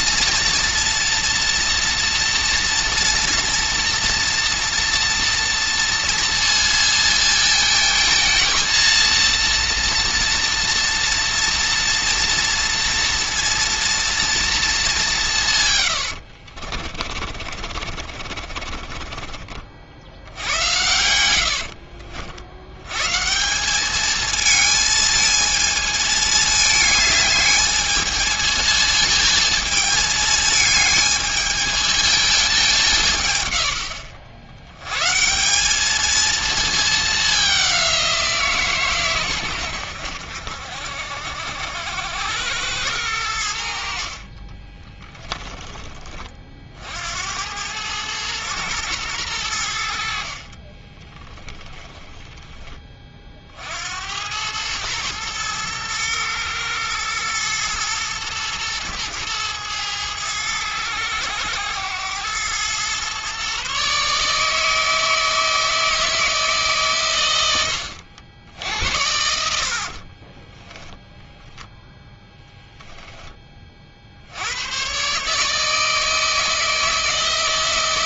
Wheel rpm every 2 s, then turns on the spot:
240, 230, 240, 230, 230, 240, 240, 200, 40, 40, 90, 120, 220, 210, 220, 220, 160, 120, 220, 140, 70, 100, 20, 60, 110, 20, 30, 110, 110, 110, 110, 120, 160, 130, 80, 10, 10, 120, 160.
16-22 44-46 50-52